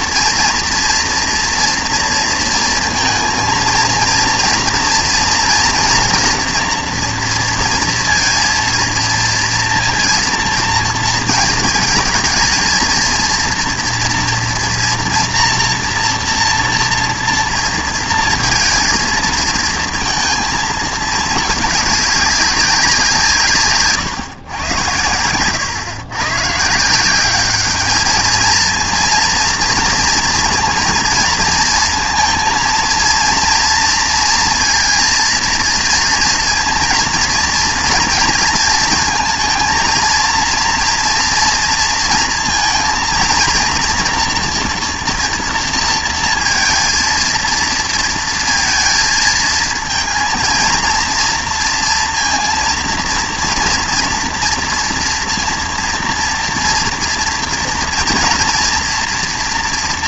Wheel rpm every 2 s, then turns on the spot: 230, 230, 230, 240, 230, 230, 230, 240, 240, 230, 230, 190, 110, 140, 220, 230, 230, 230, 230, 230, 230, 230, 240, 230, 230, 230, 230, 240, 240, 240.
none